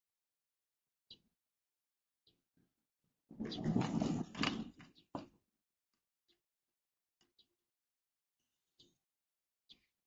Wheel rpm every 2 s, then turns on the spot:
0, 0, 0, 0, 0.
none